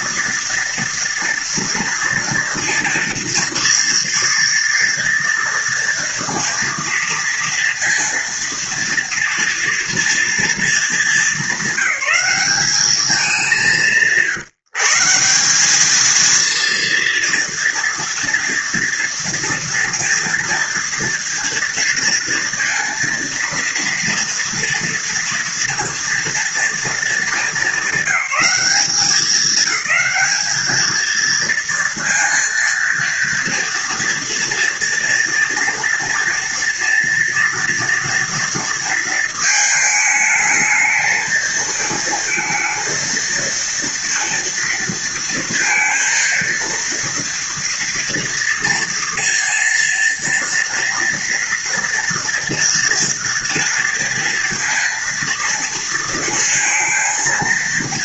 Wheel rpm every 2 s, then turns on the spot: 230, 230, 230, 230, 230, 210, 200, 160, 230, 240, 230, 230, 230, 230, 200, 220, 230, 230, 230, 230, 220, 230, 230, 230, 230, 230, 230, 230, 230.
none